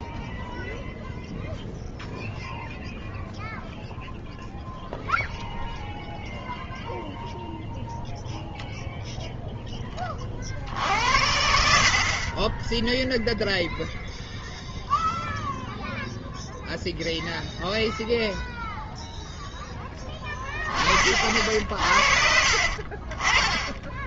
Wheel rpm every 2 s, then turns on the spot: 0, 0, 0, 0, 0, 60, 10, 0, 0, 0, 50, 40.
12-14